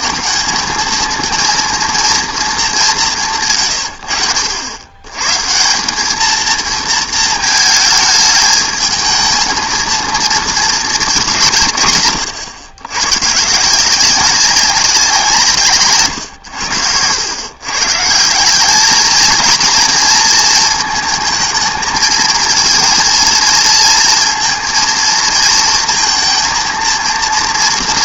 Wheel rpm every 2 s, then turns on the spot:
190, 210, 90, 220, 220, 220, 100, 190, 100, 200, 230, 230, 230, 230.
none